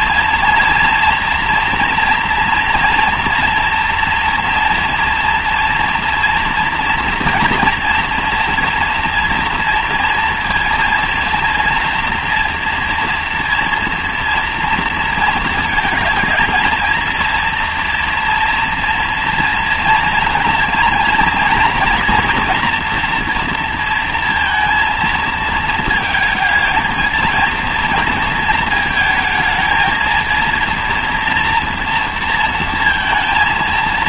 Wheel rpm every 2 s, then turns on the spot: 230, 240, 230, 230, 230, 230, 230, 240, 230, 240, 230, 230, 230, 230, 230, 230, 230.
none